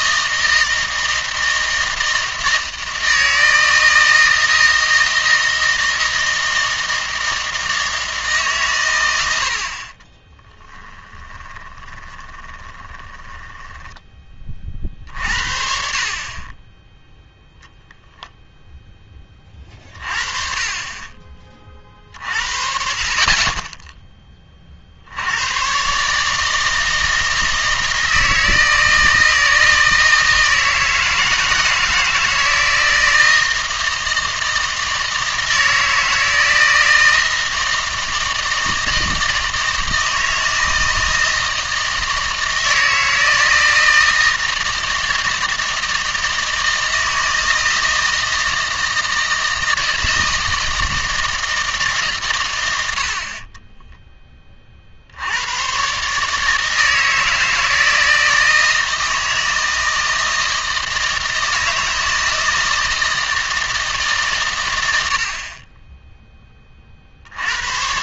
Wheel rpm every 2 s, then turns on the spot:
160, 160, 160, 160, 130, 10, 20, 40, 10, 0, 30, 40, 40, 160, 160, 160, 160, 160, 160, 160, 160, 160, 160, 160, 160, 160, 80, 40, 160, 160, 160, 160, 100, 30.
10-14